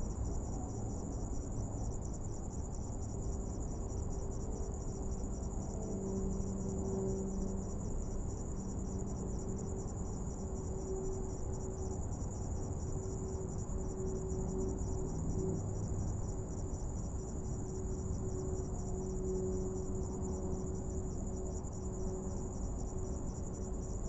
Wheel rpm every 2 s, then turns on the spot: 0, 0, 0, 0, 0, 0, 0, 0, 0, 0, 0, 0.
none